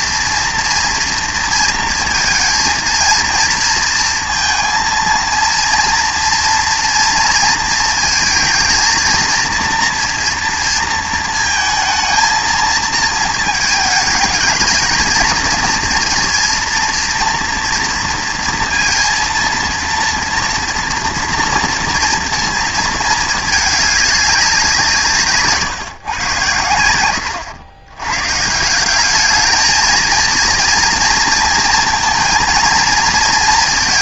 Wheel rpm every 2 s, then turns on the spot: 230, 230, 230, 230, 230, 230, 230, 220, 230, 230, 230, 230, 180, 100, 160, 230, 230.
none